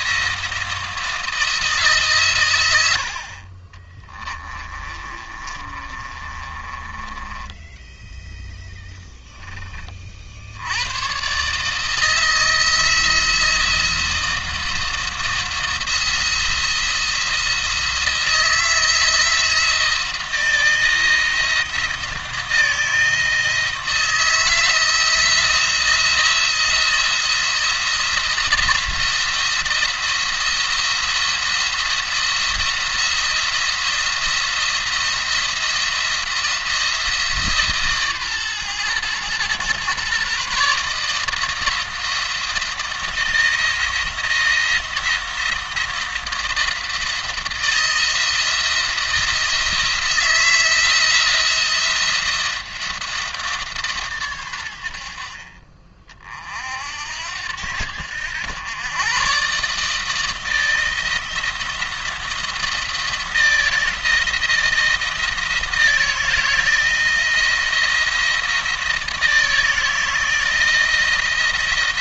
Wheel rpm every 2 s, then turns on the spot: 160, 80, 30, 20, 10, 100, 170, 170, 170, 170, 170, 170, 160, 170, 170, 170, 170, 170, 160, 120, 150, 170, 160, 170, 170, 170, 170, 80, 60, 110, 160, 170, 160, 170, 160, 170.
4-8